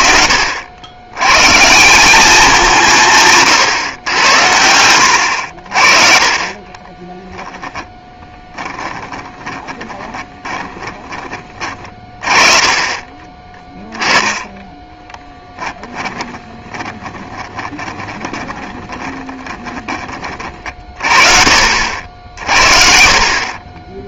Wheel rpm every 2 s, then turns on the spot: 70, 190, 90, 30, 20, 20, 30, 10, 30, 30, 40, 60.
4-14 16-20 22-24